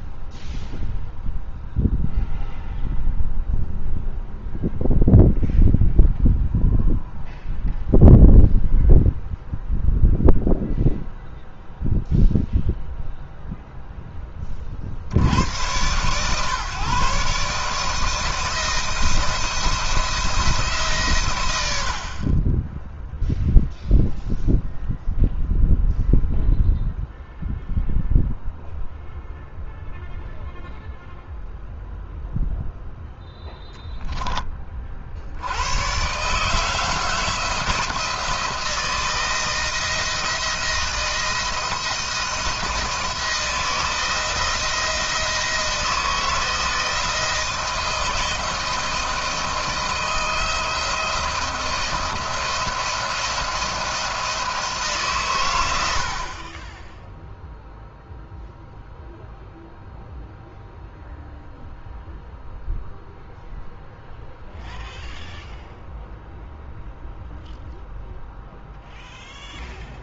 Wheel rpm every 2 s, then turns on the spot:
0, 0, 0, 0, 0, 0, 0, 50, 140, 160, 140, 10, 0, 0, 0, 0, 0, 50, 160, 160, 170, 160, 170, 160, 160, 170, 170, 140, 10, 0, 0, 0, 0, 0, 0.
56-58